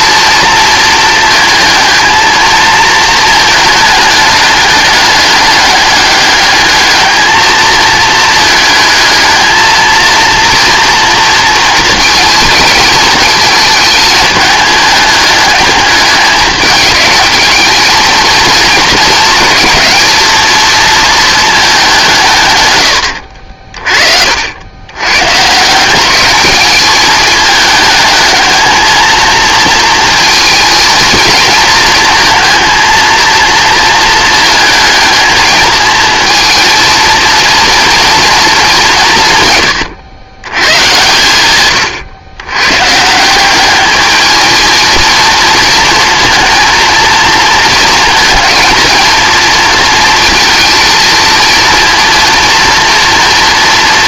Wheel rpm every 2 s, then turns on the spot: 230, 220, 210, 210, 220, 230, 220, 210, 210, 220, 220, 120, 80, 200, 220, 220, 230, 220, 220, 200, 110, 120, 220, 230, 230, 230, 230.
none